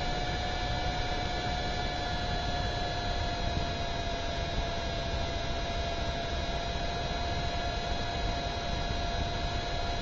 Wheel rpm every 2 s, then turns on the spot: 0, 0, 0, 0, 0.
none